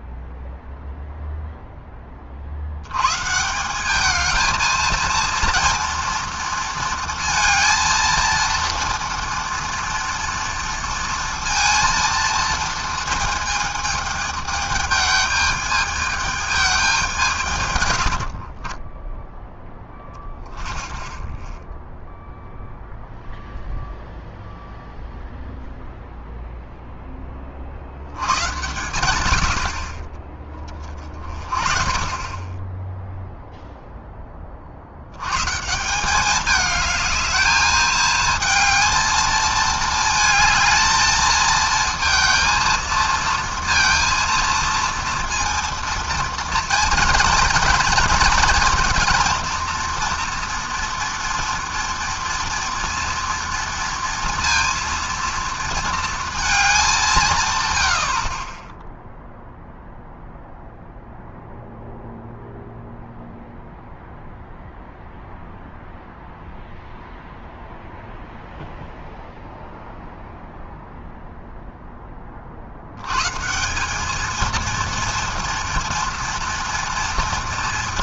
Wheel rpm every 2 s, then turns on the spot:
0, 160, 230, 230, 230, 230, 220, 210, 150, 0, 0, 0, 0, 40, 90, 30, 0, 130, 210, 220, 230, 230, 230, 230, 230, 230, 230, 230, 150, 0, 0, 0, 0, 0, 0, 0, 160, 230, 240.
none